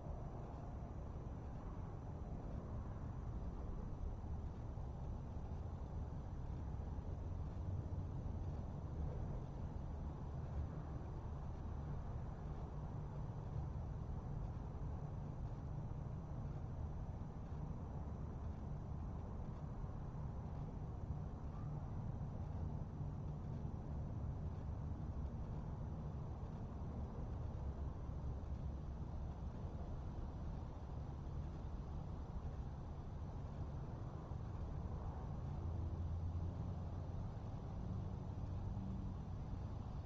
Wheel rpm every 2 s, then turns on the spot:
0, 0, 0, 0, 0, 0, 0, 0, 0, 0, 0, 0, 0, 0, 0, 0, 0, 0, 0, 0.
none